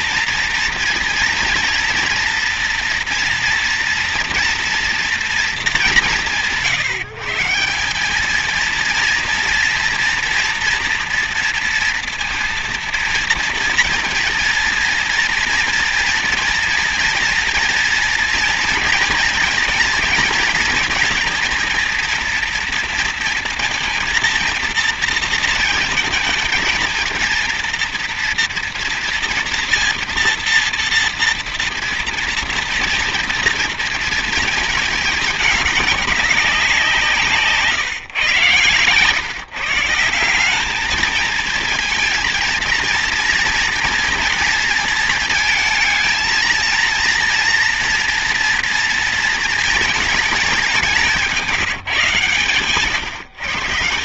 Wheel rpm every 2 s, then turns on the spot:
230, 230, 240, 170, 220, 240, 230, 230, 230, 230, 230, 230, 230, 230, 230, 230, 240, 220, 190, 130, 200, 230, 230, 230, 230, 210, 140.
38-40